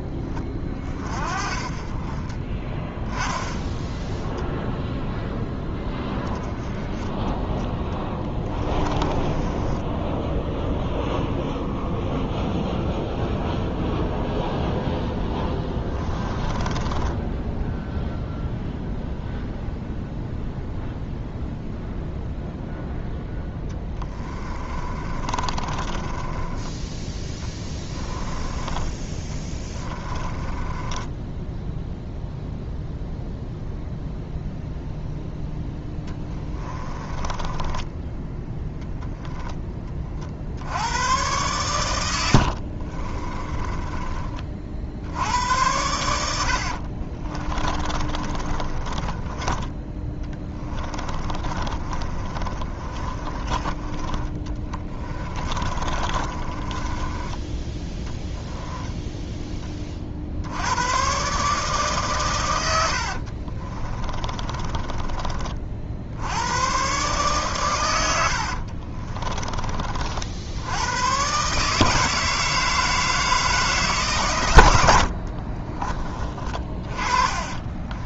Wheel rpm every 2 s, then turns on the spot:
30, 20, 0, 10, 20, 0, 0, 0, 10, 0, 0, 0, 30, 10, 20, 20, 0, 0, 20, 10, 80, 60, 50, 60, 30, 20, 30, 20, 20, 10, 90, 100, 20, 110, 60, 90, 160, 100, 30.
2-4 6-10 16-18 24-28 30-32 36-38 42-44 46-60 64-66 68-70 76-78